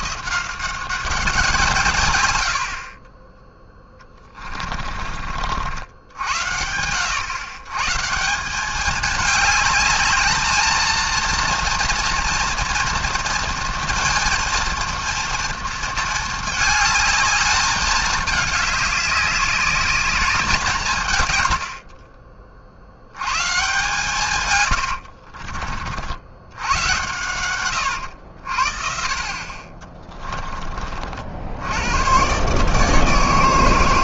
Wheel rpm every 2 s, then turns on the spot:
170, 80, 30, 80, 190, 220, 230, 230, 220, 210, 190, 50, 120, 100, 60, 30, 150.
4-6 24-26